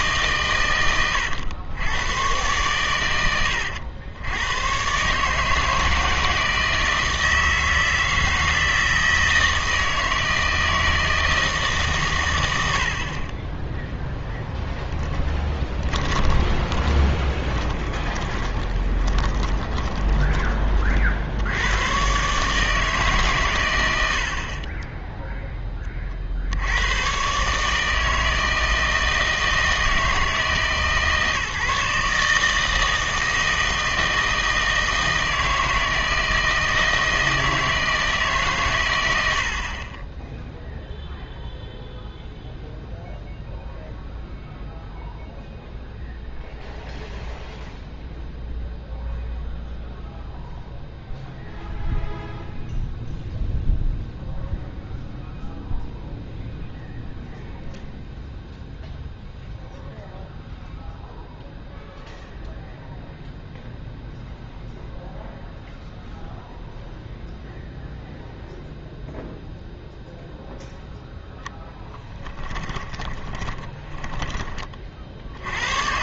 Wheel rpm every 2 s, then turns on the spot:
110, 120, 110, 160, 160, 160, 80, 10, 30, 20, 30, 150, 30, 90, 160, 160, 160, 160, 160, 130, 0, 0, 0, 0, 0, 0, 0, 0, 0, 0, 0, 0, 0, 0, 0, 0, 10, 30.
14-20 72-74